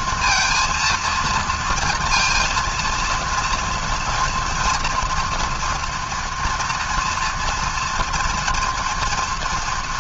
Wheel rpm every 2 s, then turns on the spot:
230, 230, 240, 230, 230.
none